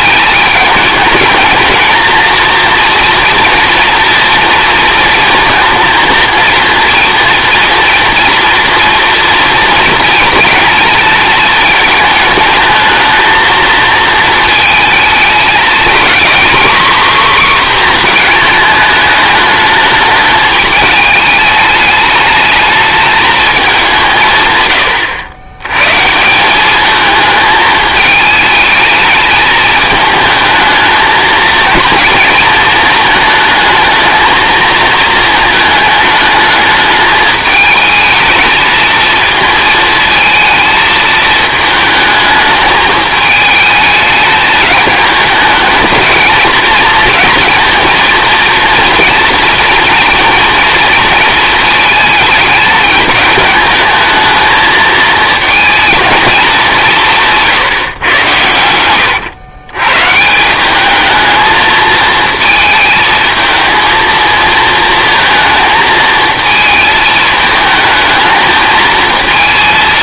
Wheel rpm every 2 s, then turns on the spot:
220, 230, 230, 230, 230, 230, 220, 220, 260, 220, 210, 210, 100, 210, 210, 220, 220, 220, 210, 220, 220, 210, 210, 230, 230, 230, 210, 220, 190, 90, 200, 220, 230, 220, 220.
58-60